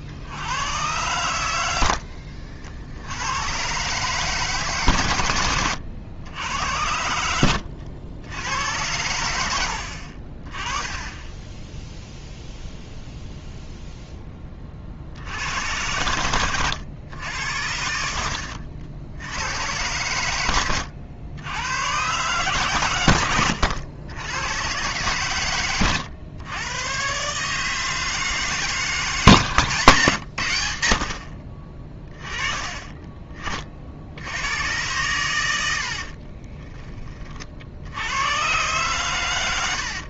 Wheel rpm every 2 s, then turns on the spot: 90, 70, 140, 80, 90, 30, 0, 30, 110, 70, 100, 120, 110, 110, 160, 80, 30, 110, 30, 120.
36-38